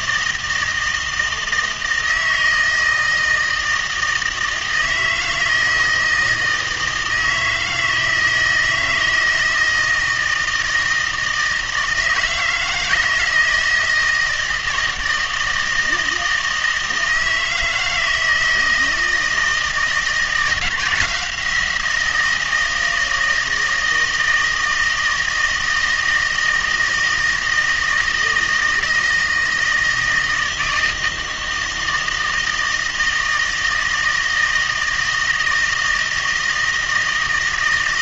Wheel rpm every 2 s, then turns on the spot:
160, 160, 160, 160, 160, 160, 160, 160, 160, 160, 170, 160, 160, 160, 160, 160, 160, 160, 160.
none